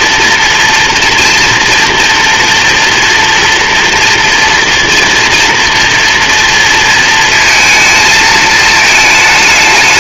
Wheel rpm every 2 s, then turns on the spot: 240, 240, 240, 230, 220.
none